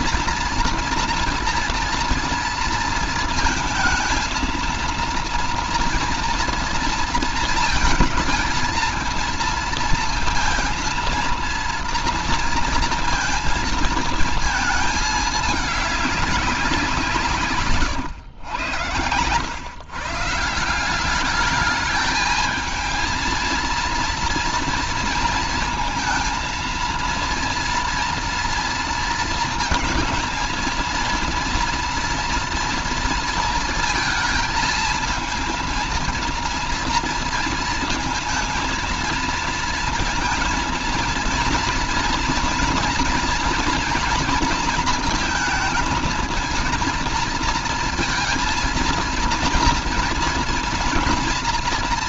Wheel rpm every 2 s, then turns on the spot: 230, 230, 230, 230, 230, 230, 230, 220, 180, 100, 180, 220, 230, 230, 230, 230, 230, 220, 230, 230, 230, 230, 230, 230, 230, 230.
none